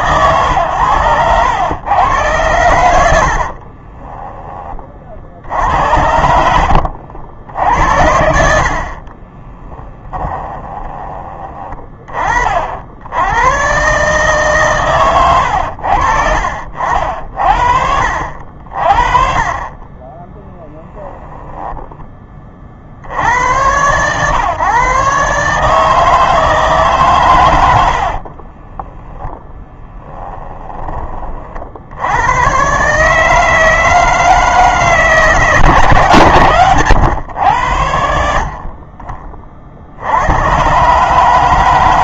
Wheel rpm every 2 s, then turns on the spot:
120, 110, 40, 60, 50, 20, 60, 130, 60, 40, 10, 40, 130, 140, 10, 20, 140, 160, 110, 40, 140.
6-8 20-22 28-30